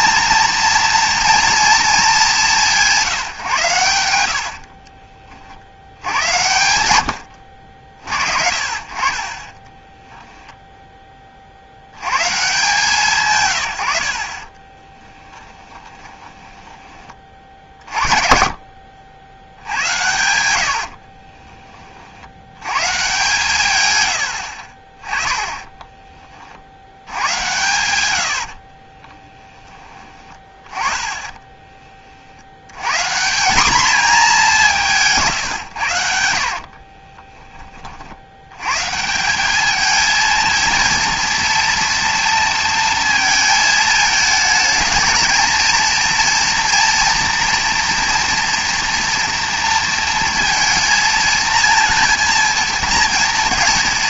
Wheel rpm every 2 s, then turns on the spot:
230, 180, 60, 100, 40, 10, 160, 20, 20, 60, 70, 120, 30, 70, 50, 20, 110, 170, 50, 120, 230, 230, 220, 230, 240, 230, 230.
4-6 14-18 20-22 28-30 36-38